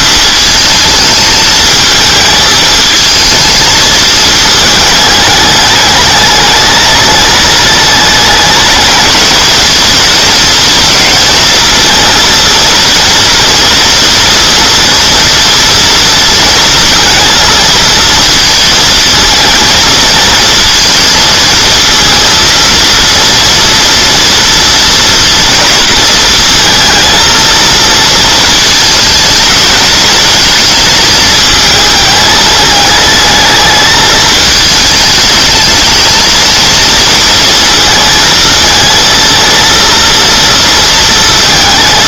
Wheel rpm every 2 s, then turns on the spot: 220, 220, 210, 210, 220, 220, 230, 240, 230, 220, 220, 230, 230, 230, 220, 230, 220, 220, 230, 230, 230.
none